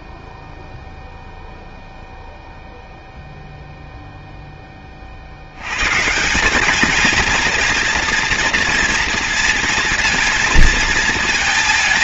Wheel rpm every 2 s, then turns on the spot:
0, 0, 10, 190, 230, 230.
none